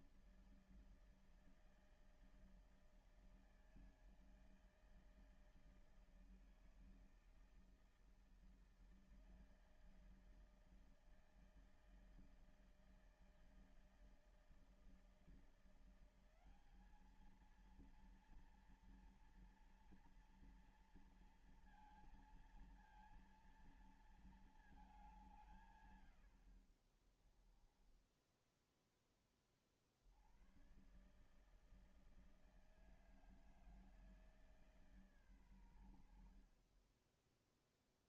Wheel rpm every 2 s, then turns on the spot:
160, 160, 160, 160, 160, 160, 160, 160, 180, 230, 230, 230, 230, 110, 10, 70, 160, 160, 70.
28-30